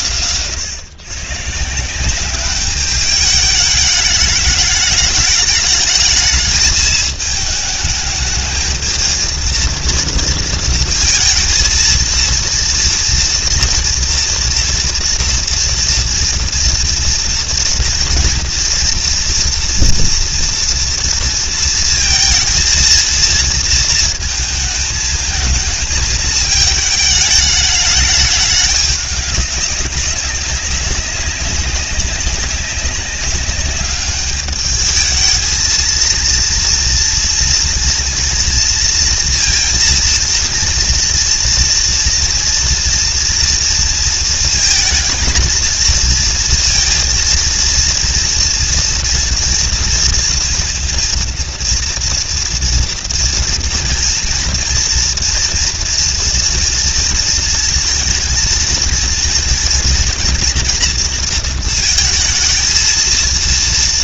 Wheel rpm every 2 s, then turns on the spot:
120, 200, 210, 220, 220, 230, 230, 230, 230, 230, 230, 230, 220, 210, 210, 200, 190, 210, 230, 230, 230, 240, 230, 230, 230, 230, 230, 230, 230, 230, 230, 220.
none